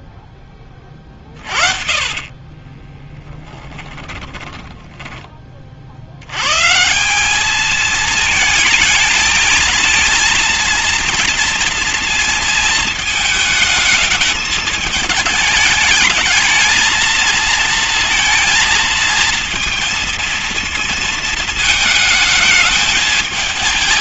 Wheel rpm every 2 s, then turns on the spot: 20, 20, 10, 140, 220, 230, 220, 210, 220, 230, 230, 220.
2-6